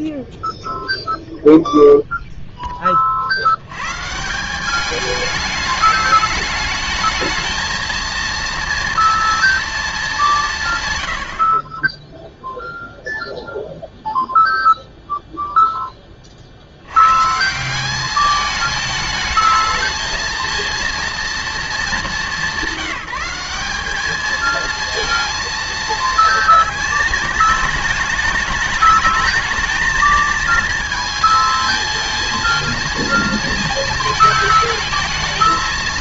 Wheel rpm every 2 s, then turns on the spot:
0, 10, 180, 210, 230, 150, 0, 0, 50, 210, 230, 190, 230, 220, 210, 220, 220, 220.
none